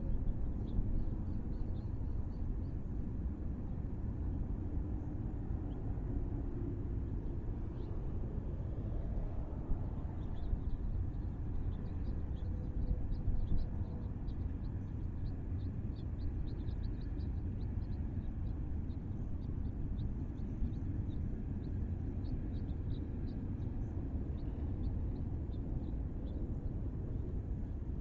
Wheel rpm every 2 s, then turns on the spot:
0, 0, 0, 0, 0, 0, 0, 0, 0, 0, 0, 0, 0, 0.
none